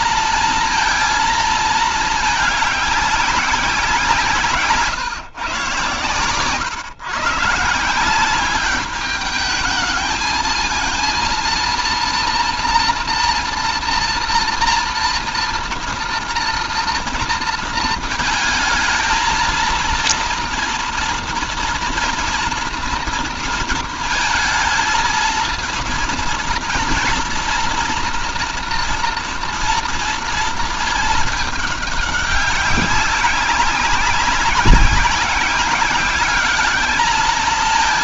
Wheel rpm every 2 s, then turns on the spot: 230, 200, 150, 140, 200, 230, 230, 230, 230, 220, 230, 240, 220, 230, 240, 220, 190, 180, 210.
none